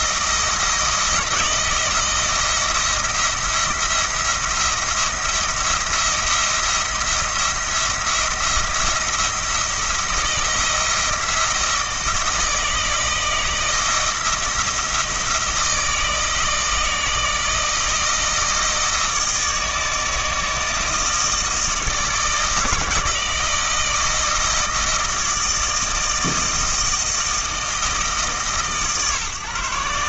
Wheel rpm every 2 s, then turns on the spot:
160, 170, 170, 170, 170, 170, 160, 160, 160, 160, 160, 160, 160, 160, 150.
none